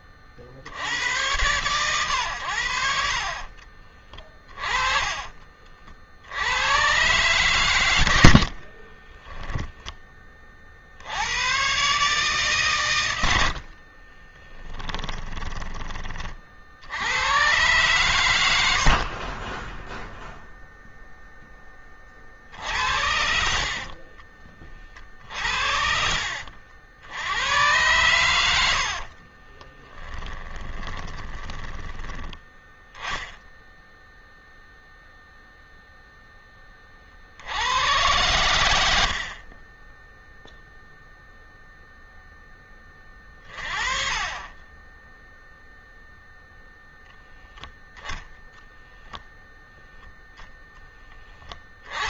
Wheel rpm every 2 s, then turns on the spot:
40, 80, 20, 90, 60, 20, 130, 30, 40, 100, 0, 30, 40, 60, 90, 10, 10, 0, 10, 120, 0, 10, 20, 0, 0, 0.
8-10 14-16 24-26 28-32